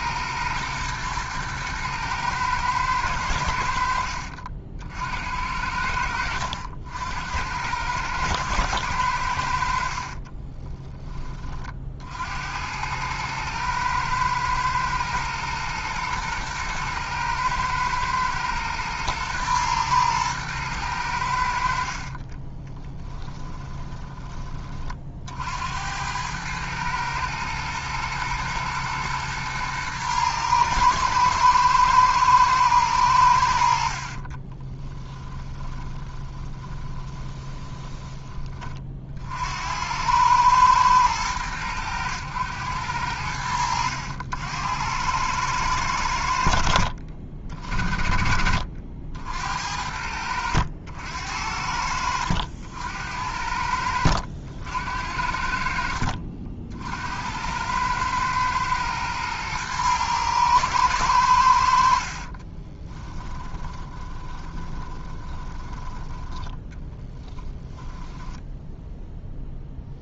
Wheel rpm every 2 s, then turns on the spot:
110, 110, 70, 70, 100, 20, 100, 110, 110, 110, 100, 10, 50, 110, 120, 110, 110, 20, 20, 40, 110, 90, 90, 60, 60, 60, 70, 70, 70, 110, 110, 20, 20, 10, 0.
22-24 34-38 62-68